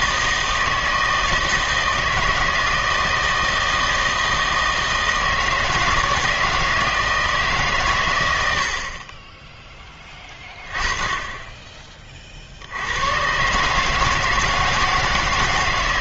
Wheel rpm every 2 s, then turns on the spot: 160, 160, 160, 160, 60, 10, 70, 160.
none